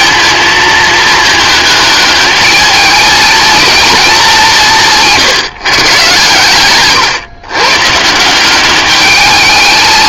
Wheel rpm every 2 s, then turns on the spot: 220, 210, 170, 120, 200.
none